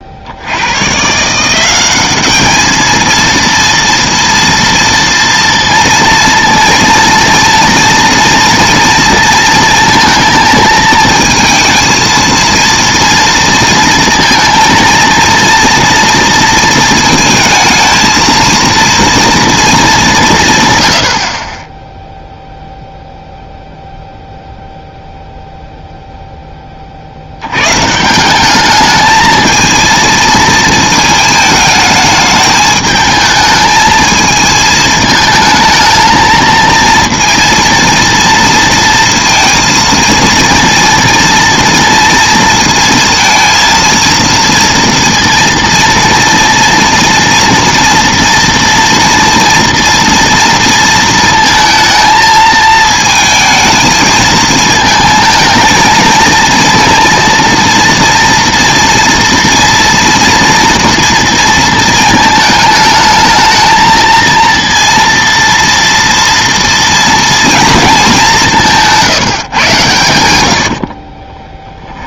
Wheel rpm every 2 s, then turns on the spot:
90, 210, 230, 230, 230, 220, 230, 230, 230, 230, 150, 0, 0, 20, 210, 220, 210, 220, 220, 230, 230, 230, 230, 230, 230, 230, 220, 220, 230, 230, 230, 220, 230, 230, 180, 80.
68-72